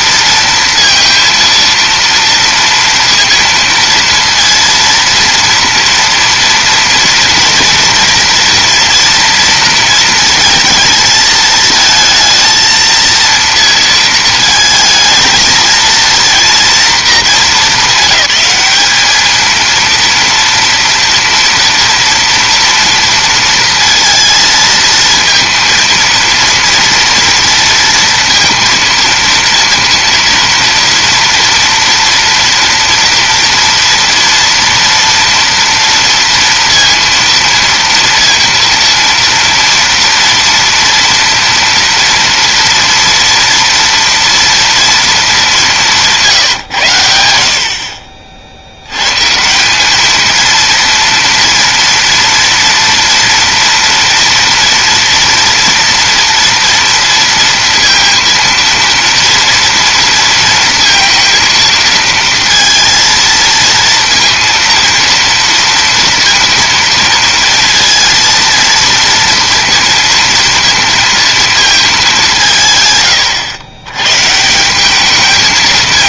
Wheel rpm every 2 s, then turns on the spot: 230, 230, 230, 230, 230, 230, 230, 220, 230, 200, 230, 230, 230, 230, 230, 240, 240, 230, 230, 230, 230, 230, 230, 120, 90, 230, 230, 230, 230, 230, 230, 220, 230, 230, 230, 230, 140, 180.
none